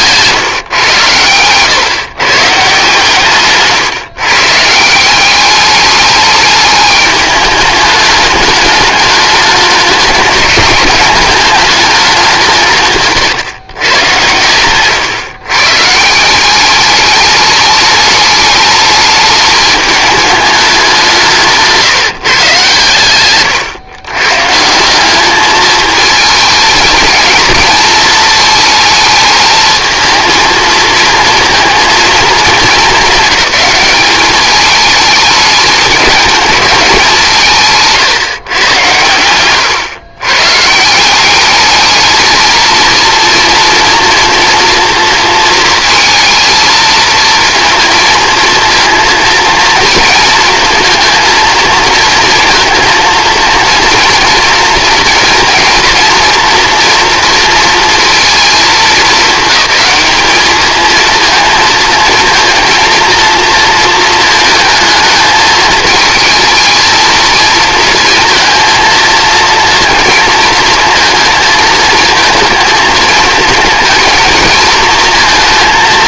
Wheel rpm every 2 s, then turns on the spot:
130, 150, 150, 210, 210, 200, 160, 120, 200, 210, 190, 120, 160, 220, 220, 230, 220, 210, 200, 120, 160, 230, 230, 230, 230, 230, 230, 230, 230, 220, 220, 230, 220, 220, 230, 230, 220, 220.
14-16